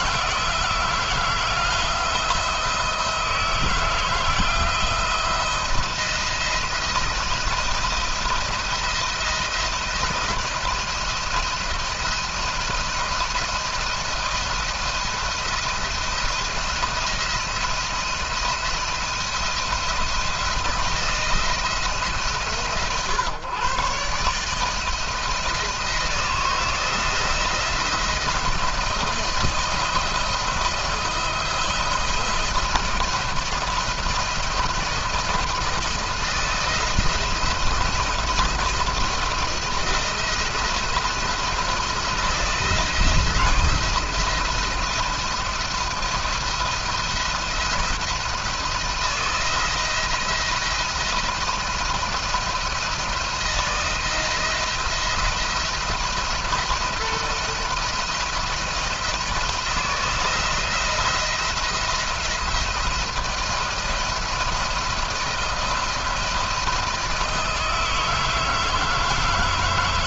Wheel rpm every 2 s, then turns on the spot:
170, 170, 170, 170, 170, 170, 170, 170, 170, 170, 160, 140, 150, 170, 170, 170, 170, 170, 170, 170, 170, 170, 160, 170, 170, 170, 170, 170, 170, 170, 170, 170, 170, 170, 160.
none